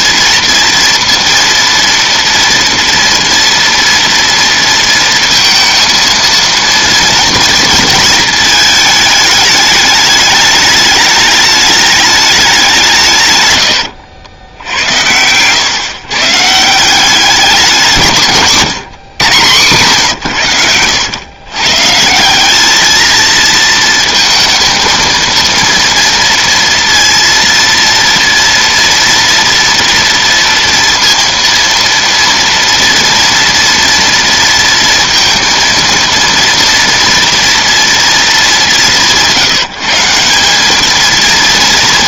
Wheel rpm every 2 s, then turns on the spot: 230, 230, 230, 230, 220, 210, 170, 80, 160, 130, 100, 210, 230, 230, 230, 230, 230, 230, 230, 200, 200.
none